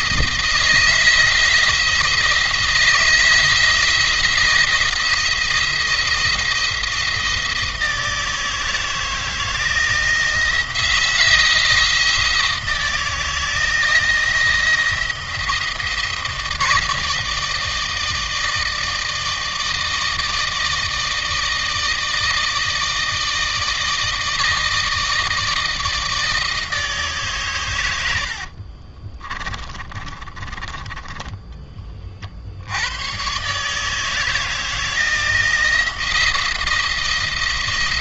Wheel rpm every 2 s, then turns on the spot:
170, 170, 170, 170, 160, 170, 170, 170, 170, 160, 160, 160, 160, 150, 40, 30, 90, 160, 170.
28-32